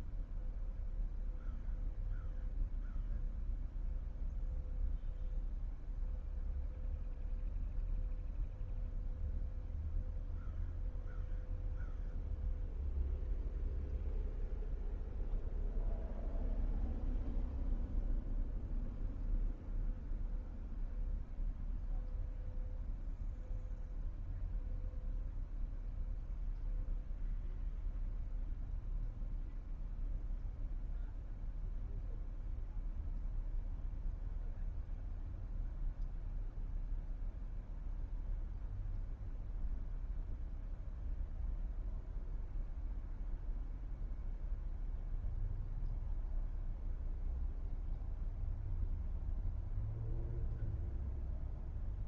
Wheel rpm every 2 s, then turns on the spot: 0, 0, 0, 0, 0, 0, 0, 0, 0, 0, 0, 0, 0, 0, 0, 0, 0, 0, 0, 0, 0, 0, 0, 0, 0, 0.
none